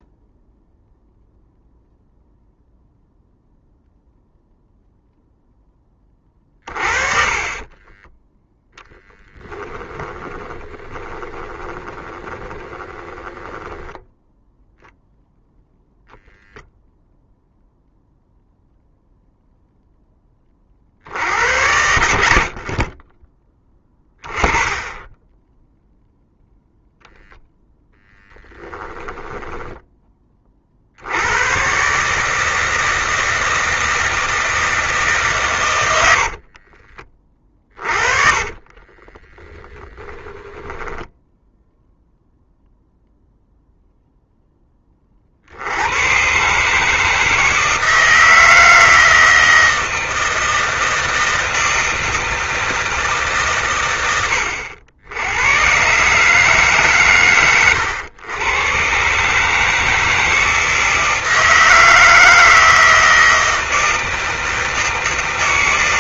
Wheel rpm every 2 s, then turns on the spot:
0, 0, 0, 30, 0, 20, 20, 0, 0, 0, 40, 40, 20, 0, 10, 50, 160, 160, 40, 30, 10, 0, 20, 150, 160, 160, 160, 90, 140, 130, 160, 160, 160.
10-14 28-30 36-42